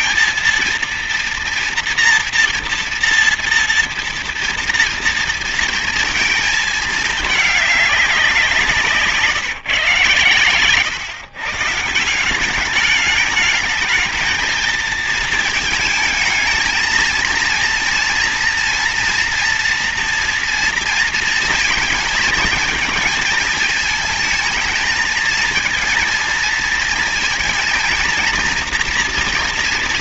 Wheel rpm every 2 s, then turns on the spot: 230, 230, 230, 220, 190, 130, 190, 220, 220, 230, 240, 220, 220, 230, 230.
none